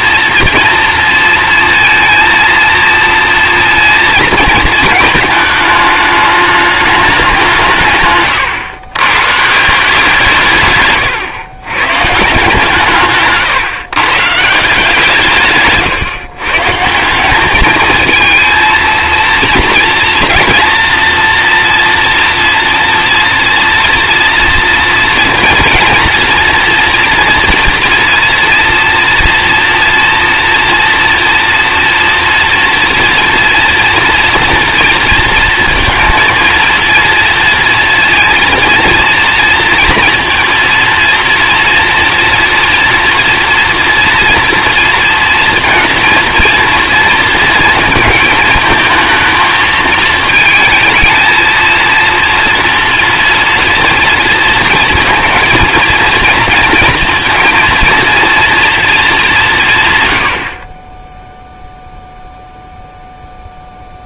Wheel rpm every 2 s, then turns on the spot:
230, 230, 220, 190, 140, 120, 150, 160, 190, 230, 230, 230, 230, 230, 230, 240, 230, 230, 230, 230, 230, 230, 230, 230, 220, 220, 230, 230, 230, 190, 0, 0.
none